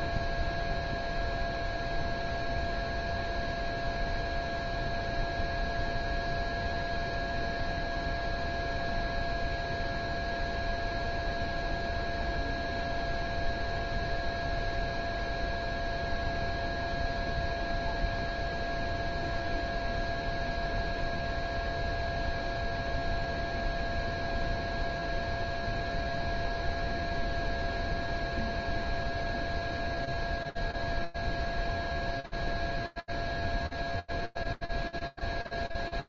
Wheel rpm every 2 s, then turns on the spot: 0, 0, 0, 0, 0, 0, 0, 0, 0, 0, 0, 0, 0, 0, 0, 0, 0, 0.
none